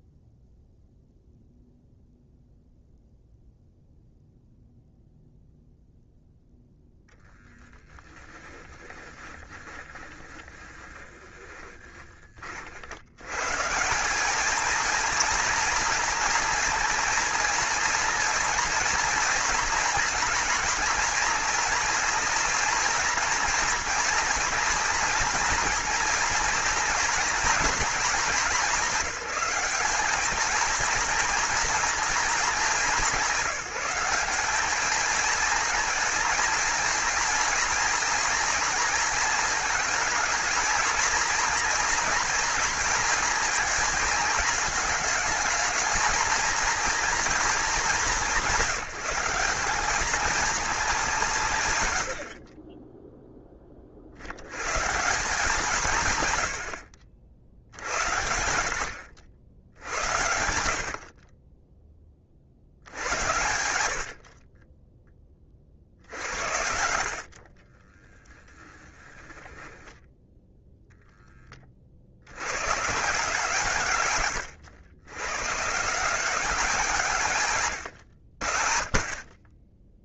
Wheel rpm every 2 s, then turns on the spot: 0, 0, 0, 0, 10, 20, 70, 230, 230, 230, 230, 230, 230, 230, 200, 230, 200, 210, 230, 230, 230, 230, 220, 230, 180, 200, 10, 150, 70, 80, 60, 70, 20, 60, 10, 0, 140, 110, 170, 40.
8-12 64-66 68-70